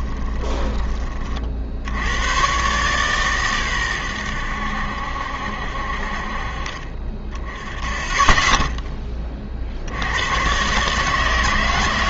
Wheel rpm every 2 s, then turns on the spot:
20, 120, 80, 40, 10, 130.
0-2